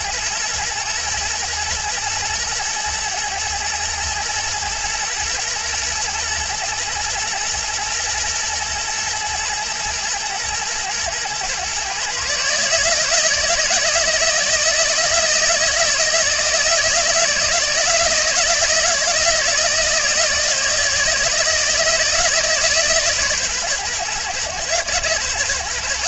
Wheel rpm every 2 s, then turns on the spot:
120, 110, 110, 120, 120, 110, 150, 160, 160, 160, 160, 150, 120.
none